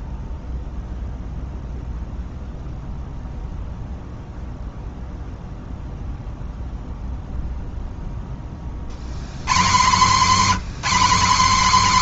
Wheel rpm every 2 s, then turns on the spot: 0, 0, 0, 0, 80, 230.
none